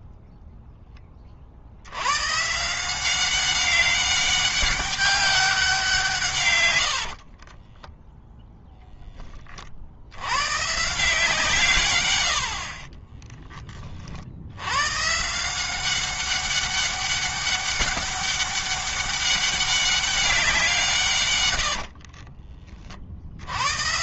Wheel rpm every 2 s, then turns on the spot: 10, 170, 200, 80, 10, 150, 30, 130, 200, 200, 160, 50.
6-8 12-14